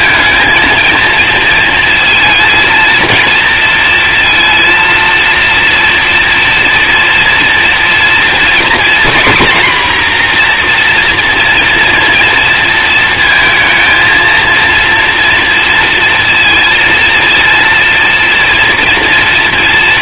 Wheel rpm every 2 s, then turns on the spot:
230, 230, 230, 240, 240, 240, 220, 230, 230, 230.
none